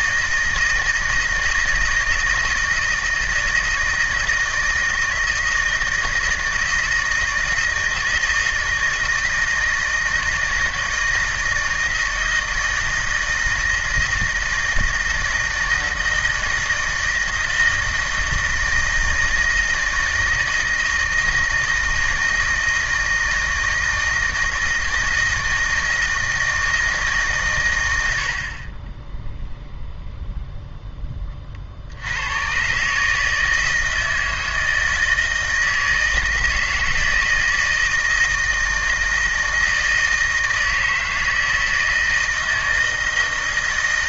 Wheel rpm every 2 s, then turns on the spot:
160, 160, 160, 160, 160, 160, 160, 160, 160, 160, 160, 160, 160, 160, 40, 0, 130, 160, 160, 160, 160, 160.
none